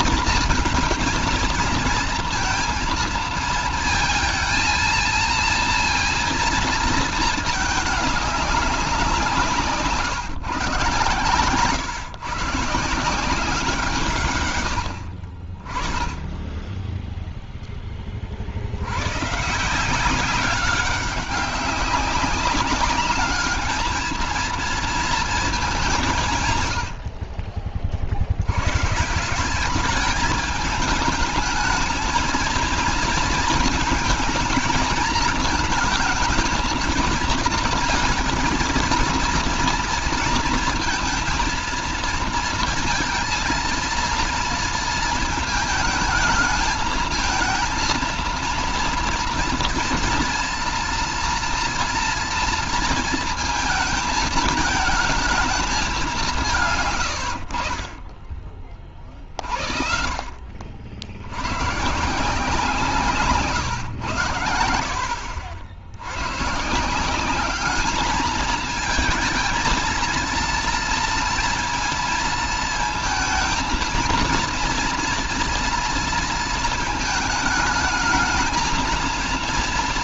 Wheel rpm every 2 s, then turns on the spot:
230, 230, 230, 230, 190, 130, 160, 50, 10, 110, 190, 210, 230, 80, 130, 210, 230, 230, 230, 230, 230, 230, 230, 220, 230, 240, 230, 220, 130, 40, 70, 160, 70, 170, 220, 230, 230, 230, 220, 220.
none